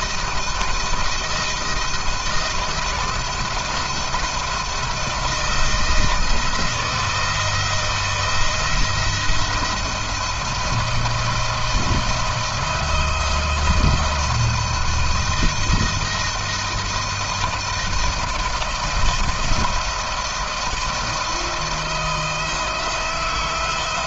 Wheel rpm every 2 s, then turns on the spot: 170, 160, 160, 160, 170, 170, 170, 170, 170, 160, 160, 160.
none